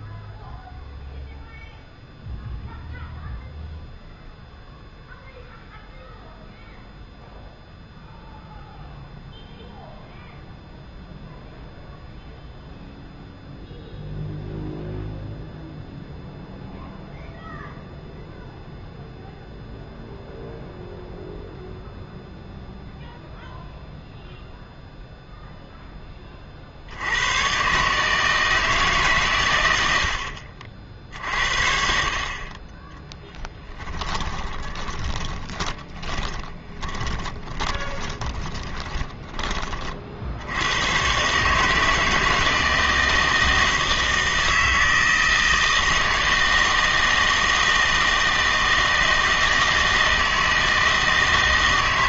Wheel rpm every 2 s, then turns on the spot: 0, 0, 0, 0, 0, 0, 0, 0, 0, 0, 0, 0, 0, 40, 150, 60, 30, 20, 20, 20, 90, 160, 160, 160, 160, 160.
34-40